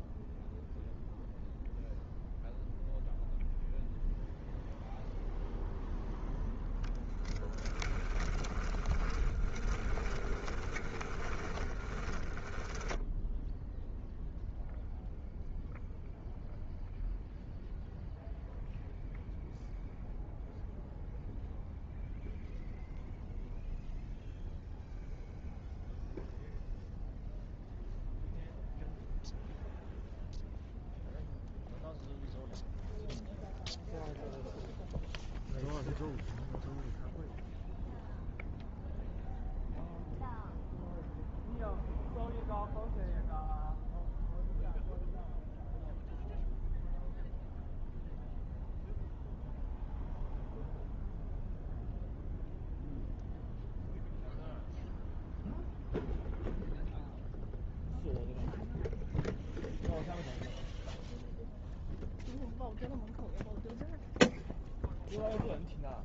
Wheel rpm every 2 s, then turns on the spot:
0, 0, 0, 10, 20, 20, 10, 0, 0, 0, 0, 0, 0, 0, 0, 0, 0, 0, 0, 0, 0, 0, 0, 0, 0, 0, 0, 0, 0, 0, 0, 0, 0.
6-14